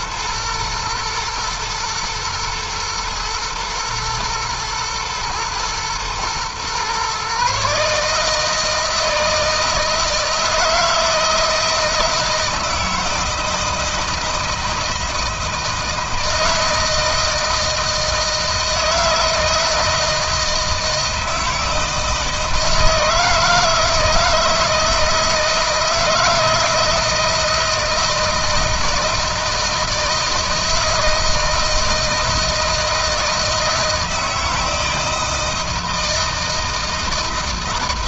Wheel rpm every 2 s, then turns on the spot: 120, 120, 120, 120, 150, 160, 160, 160, 160, 160, 160, 160, 160, 160, 160, 160, 160, 160, 160.
none